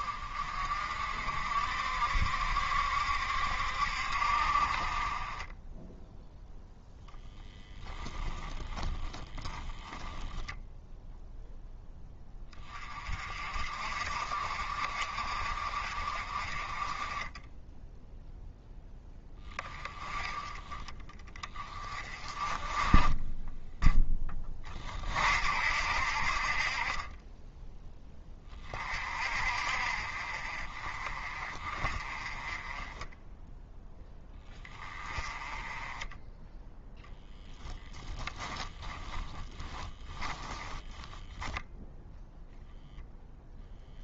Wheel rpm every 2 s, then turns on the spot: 50, 70, 40, 0, 10, 0, 30, 50, 30, 10, 30, 20, 30, 40, 30, 40, 20, 20, 0, 20, 10, 0.
8-10 38-42